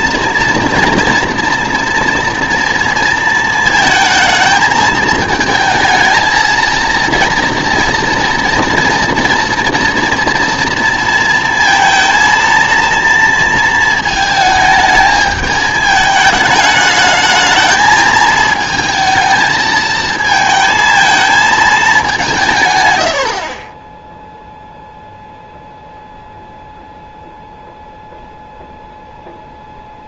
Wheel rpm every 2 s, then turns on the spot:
230, 230, 220, 230, 230, 230, 230, 220, 210, 230, 220, 150, 0, 0, 0.
none